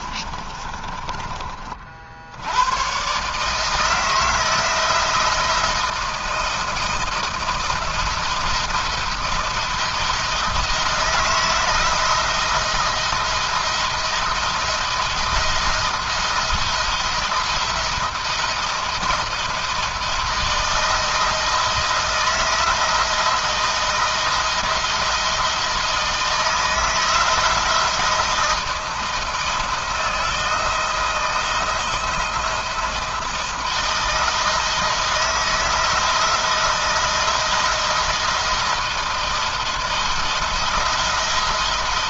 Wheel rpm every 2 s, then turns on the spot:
30, 100, 170, 170, 170, 160, 170, 170, 170, 170, 160, 170, 170, 170, 170, 160, 170, 160, 170, 170, 170.
0-2